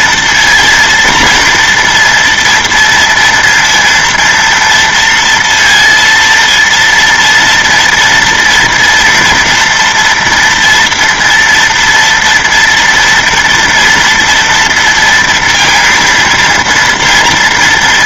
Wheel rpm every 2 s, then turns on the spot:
230, 230, 230, 230, 240, 230, 230, 230, 230.
none